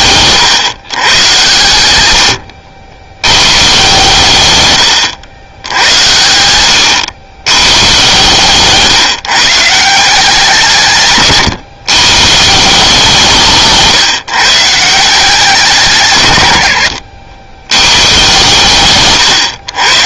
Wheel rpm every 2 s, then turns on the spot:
140, 80, 110, 90, 150, 150, 170, 160, 80, 130.
18-20